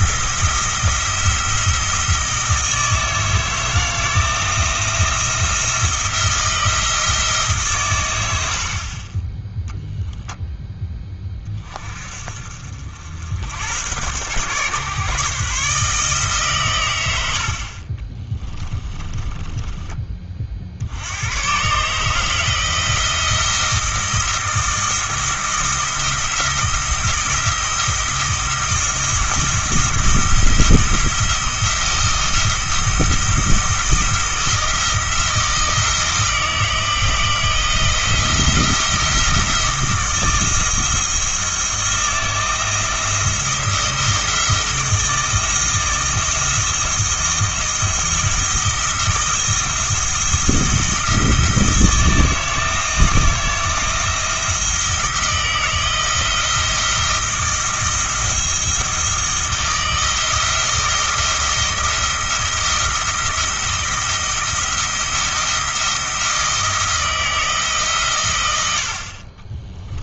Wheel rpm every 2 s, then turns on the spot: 170, 160, 170, 160, 40, 10, 60, 130, 120, 20, 60, 160, 170, 170, 170, 170, 170, 170, 160, 170, 160, 170, 170, 160, 170, 170, 160, 170, 170, 160, 160, 170, 160, 170, 70.
18-20